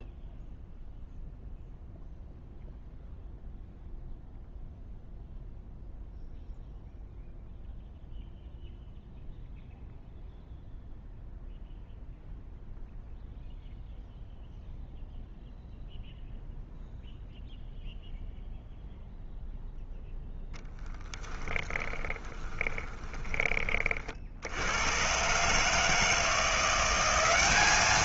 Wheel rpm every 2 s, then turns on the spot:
0, 0, 0, 0, 0, 0, 0, 0, 0, 0, 10, 20, 80, 170.
20-24